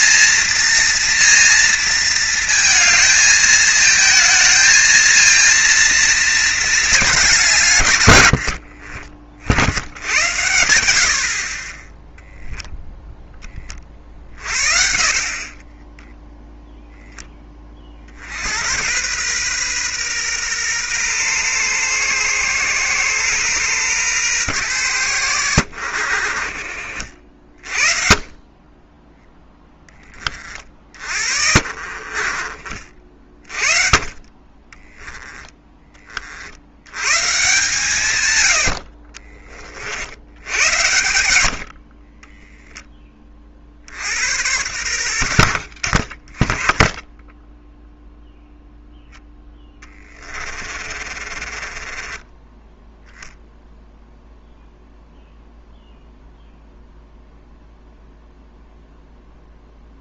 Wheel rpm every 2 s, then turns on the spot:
230, 230, 220, 220, 50, 90, 0, 50, 0, 90, 120, 120, 110, 60, 20, 40, 40, 20, 90, 60, 100, 20, 90, 10, 0, 30, 10, 0, 0, 0.
8-10 42-44 50-52